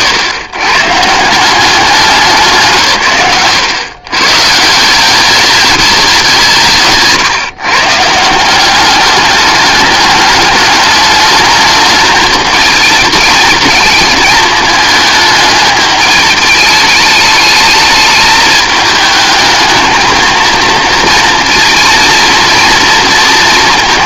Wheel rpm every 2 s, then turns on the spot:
100, 150, 160, 160, 190, 210, 220, 220, 210, 220, 230, 230.
none